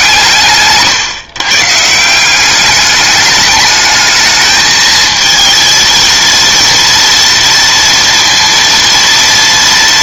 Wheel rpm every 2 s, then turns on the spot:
140, 200, 220, 230, 230.
none